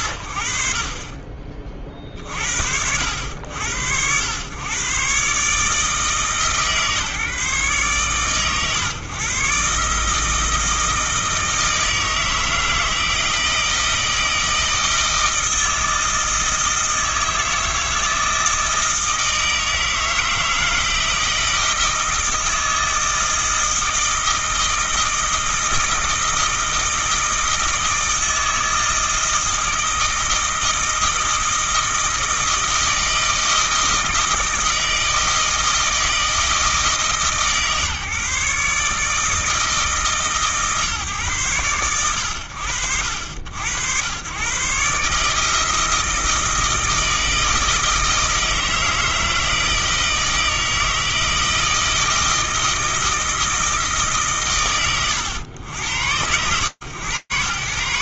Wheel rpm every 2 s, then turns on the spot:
30, 110, 150, 120, 160, 160, 160, 160, 160, 160, 160, 160, 160, 160, 160, 160, 160, 160, 150, 150, 90, 90, 160, 160, 160, 160, 140, 90, 90.
none